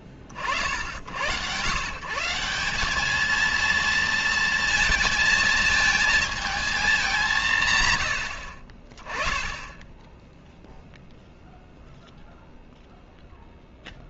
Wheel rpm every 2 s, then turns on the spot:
50, 180, 230, 220, 60, 0, 0.
none